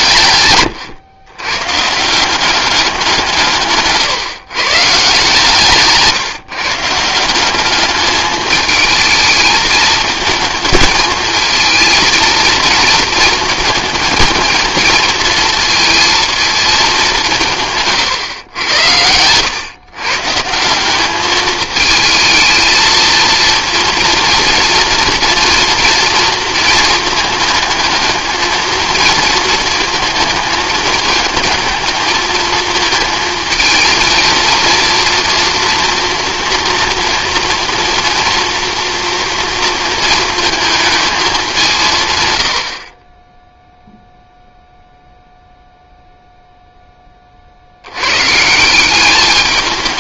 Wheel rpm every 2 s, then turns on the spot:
120, 180, 130, 150, 220, 220, 220, 220, 220, 110, 170, 220, 230, 230, 220, 220, 220, 230, 230, 230, 220, 80, 0, 0, 180.
0-2